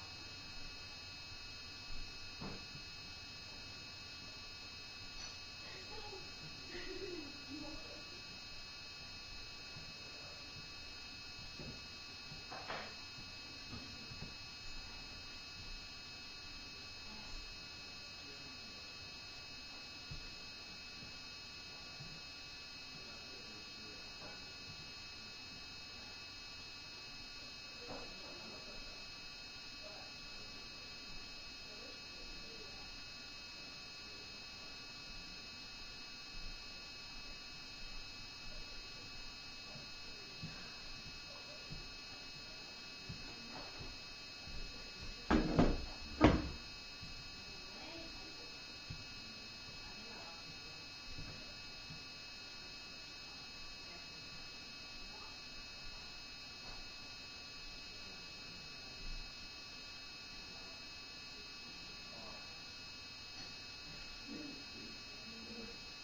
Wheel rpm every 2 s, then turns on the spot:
0, 0, 0, 0, 0, 0, 0, 0, 0, 0, 0, 0, 0, 0, 0, 0, 0, 0, 0, 0, 0, 0, 0, 0, 0, 0, 0, 0, 0, 0, 0, 0, 0.
none